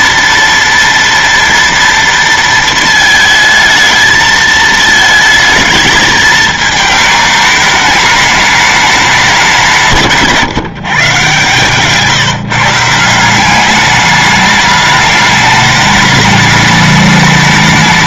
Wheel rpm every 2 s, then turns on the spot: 230, 230, 220, 220, 210, 150, 150, 210, 210.
none